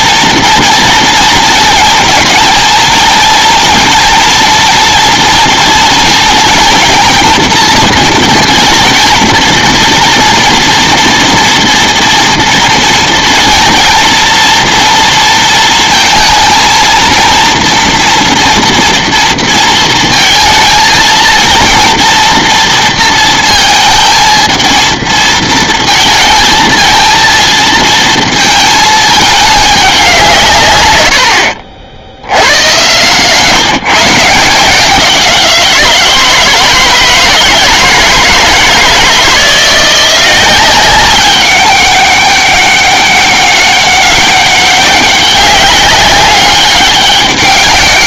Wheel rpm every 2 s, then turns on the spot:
230, 220, 230, 230, 220, 230, 230, 230, 230, 230, 230, 230, 230, 220, 220, 120, 100, 170, 160, 160, 190, 200, 200, 200.
none